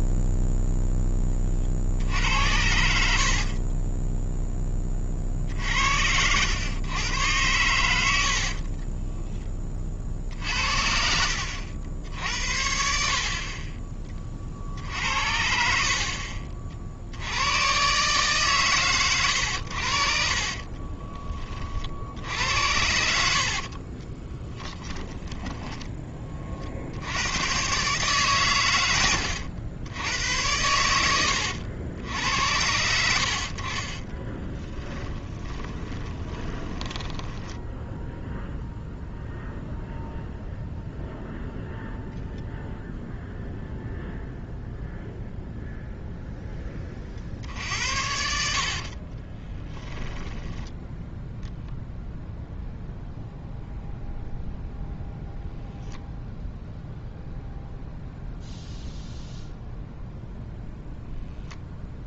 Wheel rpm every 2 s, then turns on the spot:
0, 70, 30, 110, 30, 60, 60, 60, 60, 130, 30, 80, 10, 60, 100, 90, 80, 10, 20, 0, 0, 0, 0, 20, 50, 0, 0, 0, 0, 0, 0.
8-10 20-22 24-26 34-38 48-50